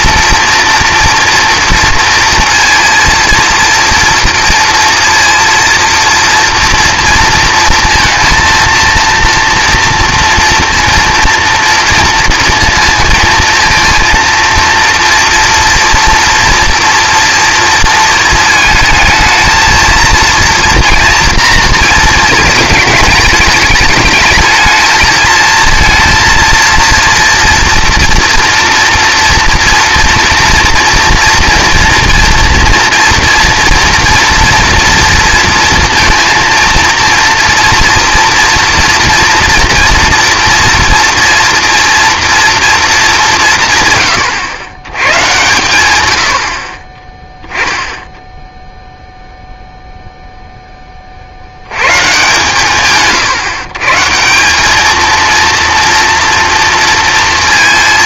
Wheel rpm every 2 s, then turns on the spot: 230, 230, 230, 230, 230, 230, 230, 230, 230, 220, 230, 220, 220, 230, 230, 230, 230, 230, 230, 230, 230, 230, 120, 40, 0, 10, 140, 200, 230.
none